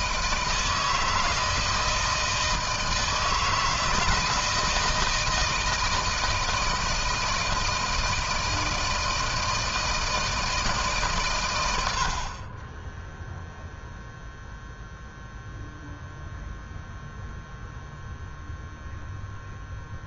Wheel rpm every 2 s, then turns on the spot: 160, 160, 160, 160, 160, 160, 30, 0, 0, 0.
none